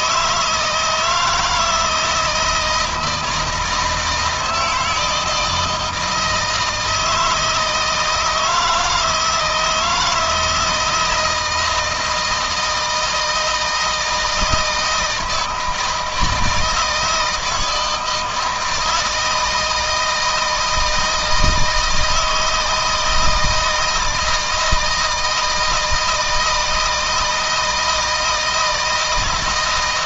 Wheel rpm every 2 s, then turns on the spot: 160, 160, 160, 160, 160, 160, 160, 160, 160, 160, 160, 160, 160, 160, 160.
none